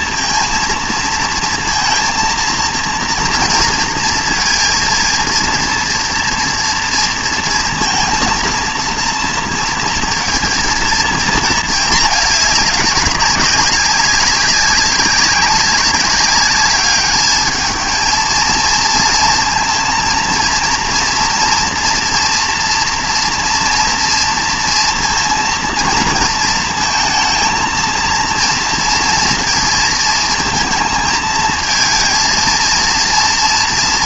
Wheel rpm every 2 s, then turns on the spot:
230, 230, 230, 230, 230, 230, 210, 190, 200, 230, 230, 230, 230, 230, 240, 220, 230.
none